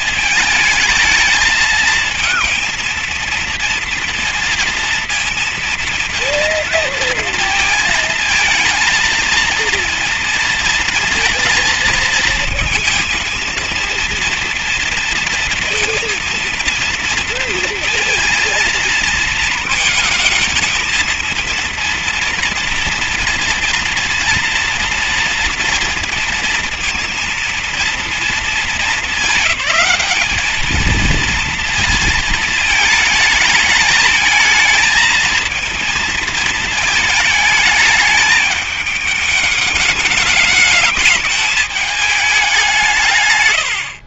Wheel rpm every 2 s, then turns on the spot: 220, 230, 230, 230, 220, 230, 230, 230, 230, 230, 220, 230, 230, 230, 220, 220, 220, 230, 220, 210, 210, 170.
none